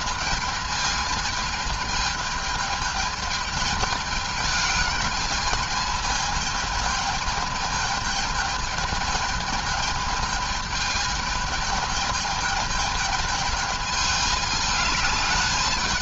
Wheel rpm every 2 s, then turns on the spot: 220, 220, 220, 220, 220, 220, 210, 210.
none